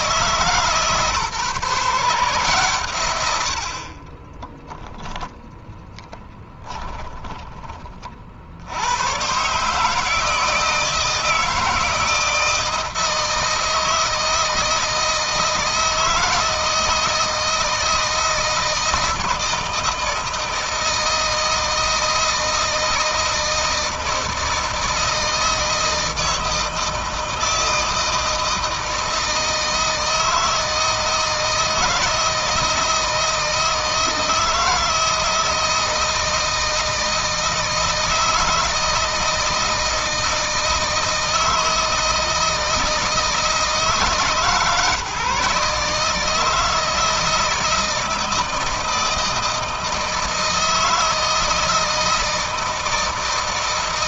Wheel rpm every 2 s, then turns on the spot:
150, 120, 0, 10, 100, 160, 160, 160, 160, 160, 160, 160, 160, 160, 160, 160, 160, 160, 160, 160, 160, 160, 150, 160, 160, 160, 160.
6-8